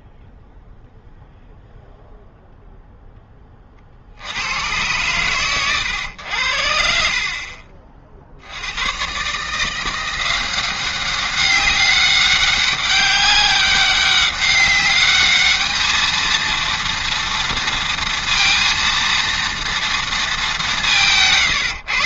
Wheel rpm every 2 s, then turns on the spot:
0, 0, 100, 60, 90, 190, 190, 200, 230, 230, 190.
none